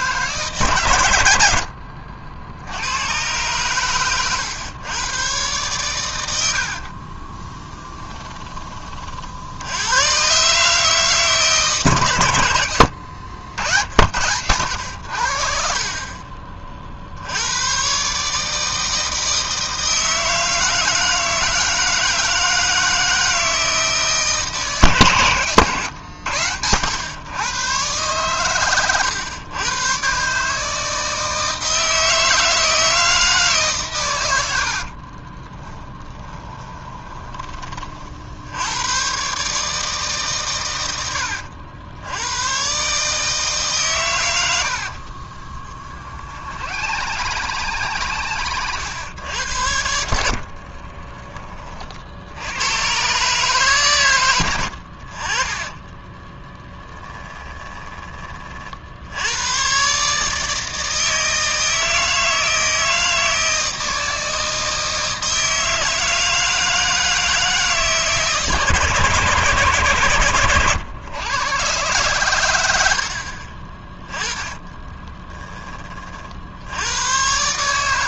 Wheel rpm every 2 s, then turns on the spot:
130, 90, 110, 60, 30, 140, 90, 80, 50, 160, 160, 160, 150, 100, 120, 160, 160, 60, 20, 90, 110, 130, 70, 90, 100, 50, 90, 80, 10, 40, 160, 160, 160, 160, 160, 110, 80, 20, 80.
34-38 44-48 50-52 54-58 74-76